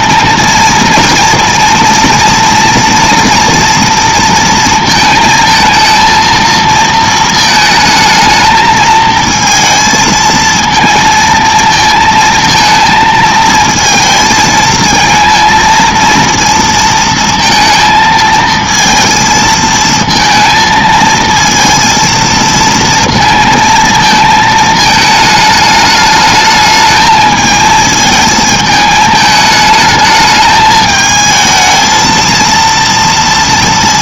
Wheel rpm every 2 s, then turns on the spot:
230, 230, 230, 230, 220, 220, 230, 220, 230, 230, 230, 230, 220, 210, 220, 220, 230.
none